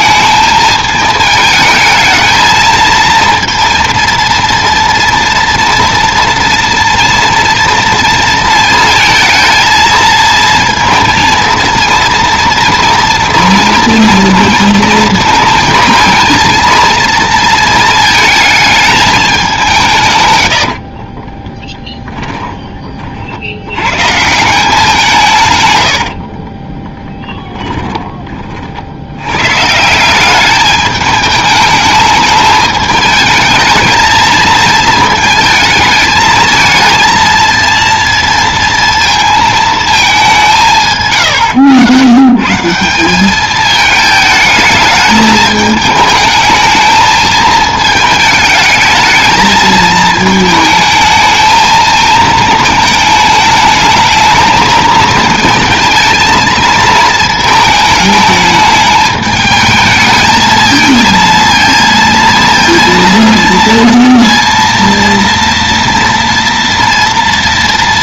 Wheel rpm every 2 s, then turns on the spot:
220, 230, 230, 230, 230, 230, 230, 230, 230, 220, 60, 30, 180, 10, 70, 210, 220, 220, 220, 230, 150, 180, 220, 220, 210, 220, 220, 220, 220, 220, 220, 230, 230, 240.
20-22 26-28